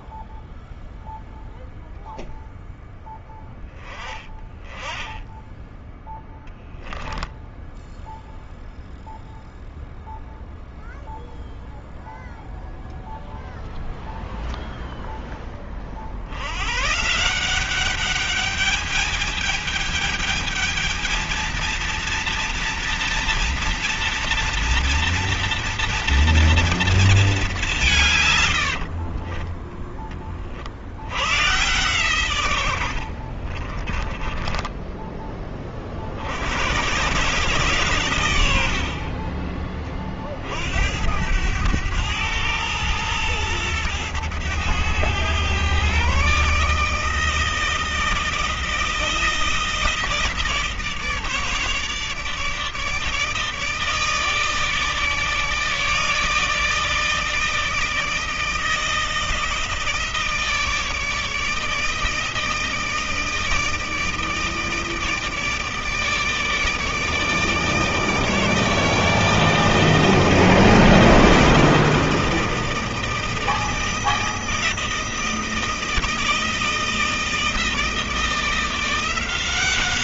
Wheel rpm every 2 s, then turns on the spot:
0, 0, 10, 0, 0, 0, 0, 0, 130, 210, 220, 230, 230, 230, 80, 70, 80, 20, 100, 60, 70, 110, 110, 150, 160, 160, 150, 150, 160, 160, 160, 160, 160, 150, 160, 160, 160, 160, 160, 170.
28-30 32-36 38-40